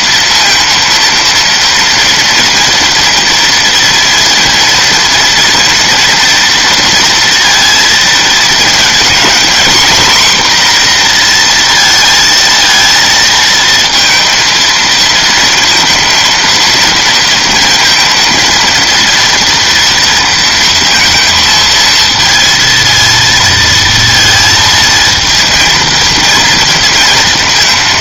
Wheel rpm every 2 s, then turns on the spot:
230, 230, 230, 230, 230, 240, 230, 230, 230, 230, 230, 230, 230, 230.
none